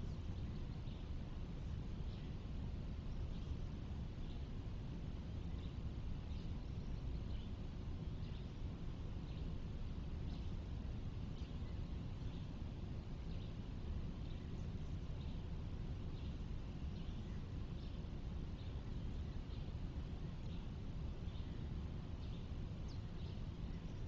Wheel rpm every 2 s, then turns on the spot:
0, 0, 0, 0, 0, 0, 0, 0, 0, 0, 0, 0.
none